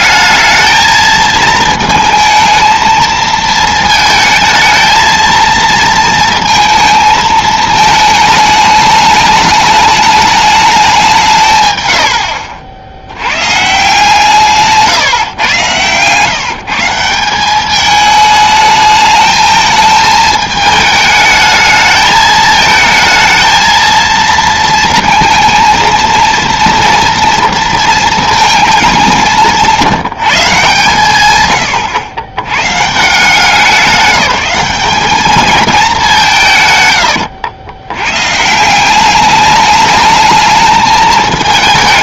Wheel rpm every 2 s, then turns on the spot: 220, 230, 220, 230, 210, 210, 70, 150, 160, 210, 220, 220, 220, 230, 220, 150, 130, 190, 150, 170, 220.
none